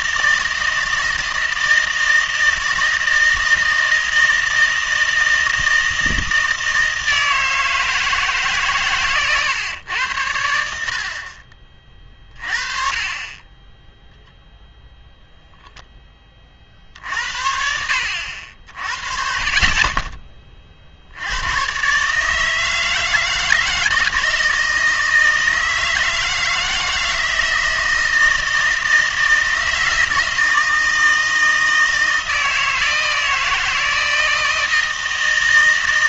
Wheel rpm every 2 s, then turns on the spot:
160, 160, 160, 160, 140, 70, 30, 0, 50, 50, 40, 160, 160, 160, 160, 160, 160, 160.
none